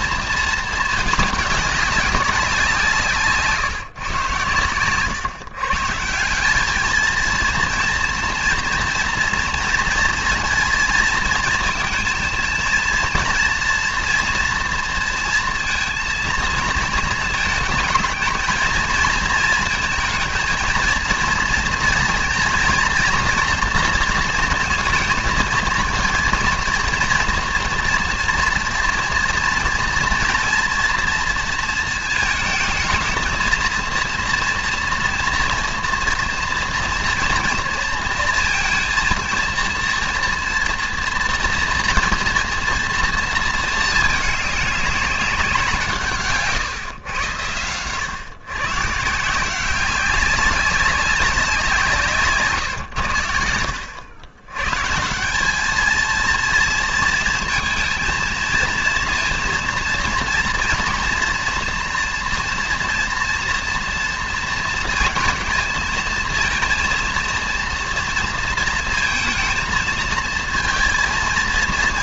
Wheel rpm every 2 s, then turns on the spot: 220, 170, 120, 220, 230, 230, 230, 230, 230, 220, 230, 240, 230, 230, 230, 230, 220, 230, 230, 230, 230, 230, 200, 120, 150, 190, 110, 150, 230, 230, 230, 240, 230, 230, 230, 230.
4-6